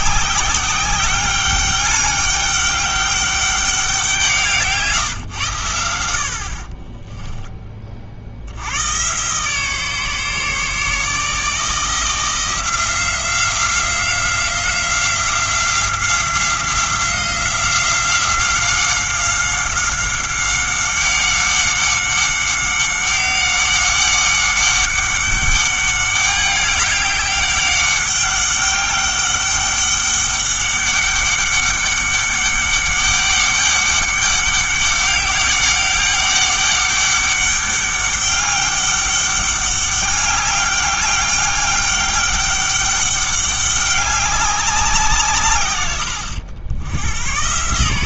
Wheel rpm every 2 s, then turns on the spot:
190, 200, 160, 40, 90, 150, 170, 180, 180, 190, 190, 190, 200, 200, 200, 200, 200, 200, 200, 200, 200, 200, 190, 90.
none